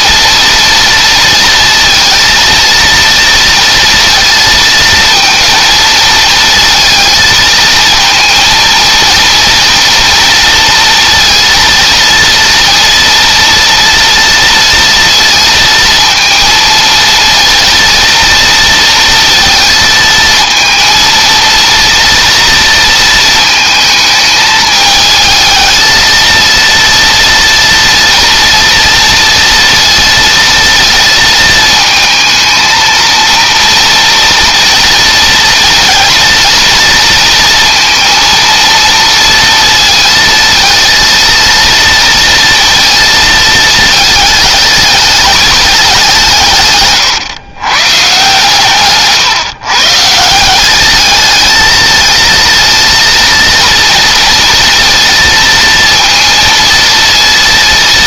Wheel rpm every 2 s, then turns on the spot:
230, 230, 230, 220, 230, 230, 230, 230, 230, 230, 230, 230, 220, 230, 230, 230, 230, 230, 230, 230, 230, 230, 210, 130, 140, 220, 230, 230, 230.
none